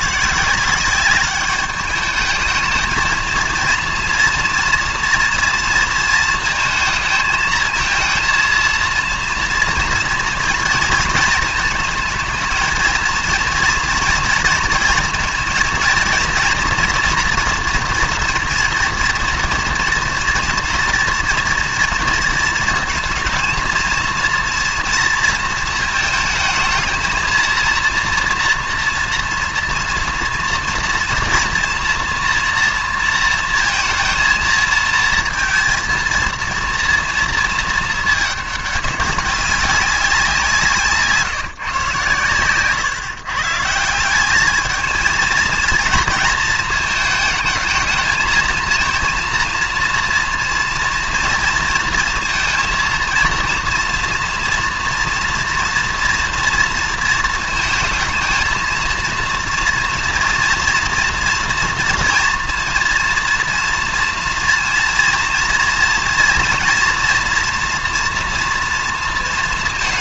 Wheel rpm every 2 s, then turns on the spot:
180, 220, 230, 230, 230, 230, 220, 230, 240, 230, 230, 230, 230, 220, 230, 230, 230, 230, 230, 210, 160, 130, 210, 220, 230, 230, 230, 230, 230, 230, 230, 230, 230, 230, 230.
none